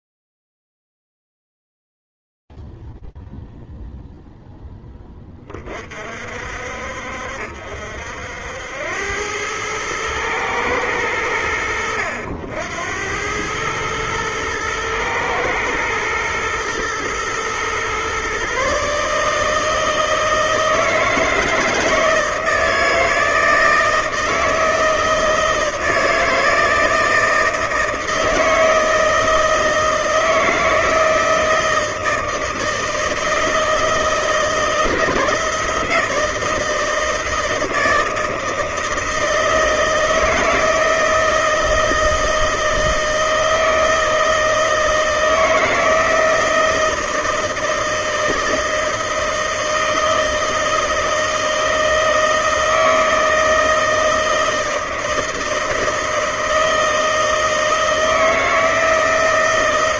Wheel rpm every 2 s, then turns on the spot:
0, 0, 0, 50, 70, 110, 80, 110, 110, 130, 160, 160, 160, 160, 160, 160, 160, 160, 160, 160, 160, 160, 160, 160, 160, 160, 160, 160, 160, 160.
none